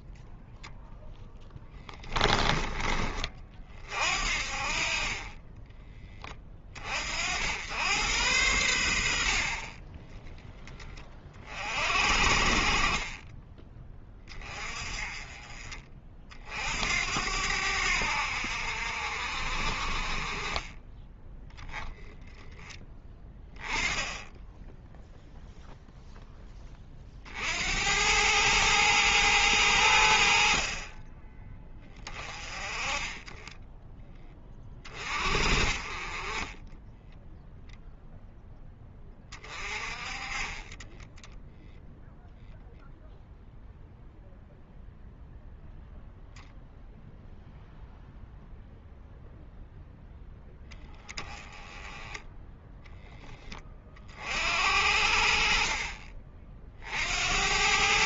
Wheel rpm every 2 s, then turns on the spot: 0, 20, 40, 40, 80, 20, 40, 30, 60, 60, 20, 10, 0, 20, 110, 40, 30, 30, 10, 10, 20, 0, 0, 0, 0, 10, 0, 70, 50.
none